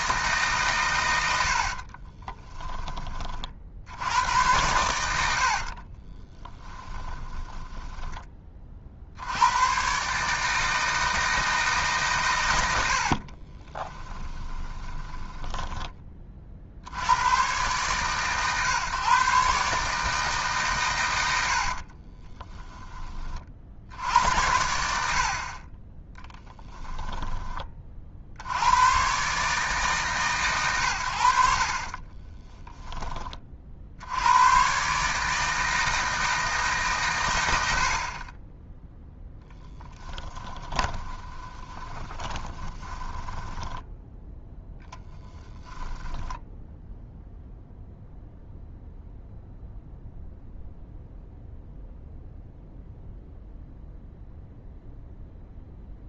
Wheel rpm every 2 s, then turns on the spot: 120, 20, 90, 10, 50, 160, 70, 20, 50, 130, 120, 20, 80, 10, 100, 110, 10, 130, 150, 10, 10, 10, 10, 0, 0, 0, 0, 0.
6-8 12-16 22-24 26-28 42-46